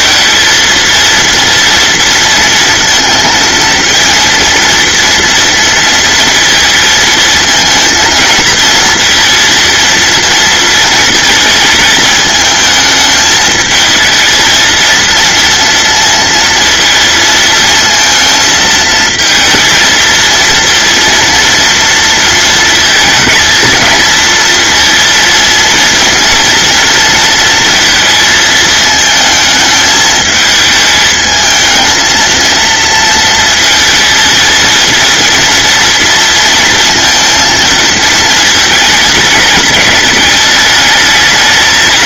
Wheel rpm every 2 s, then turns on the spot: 230, 230, 230, 230, 230, 230, 220, 220, 230, 230, 230, 230, 230, 230, 230, 220, 220, 230, 230, 230, 210.
none